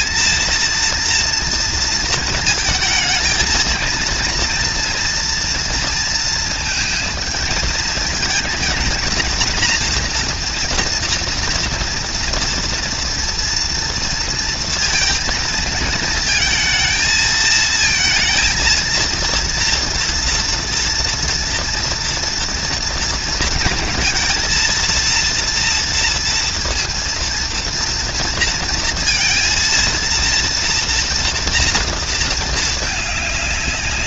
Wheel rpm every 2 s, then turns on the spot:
230, 220, 230, 230, 230, 230, 240, 230, 220, 230, 230, 230, 230, 230, 230, 230, 210.
none